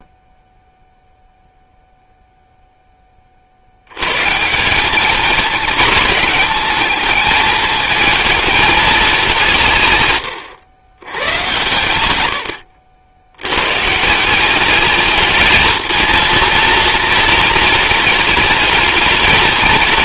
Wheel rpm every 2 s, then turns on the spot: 0, 10, 210, 220, 210, 120, 60, 210, 230, 220.
none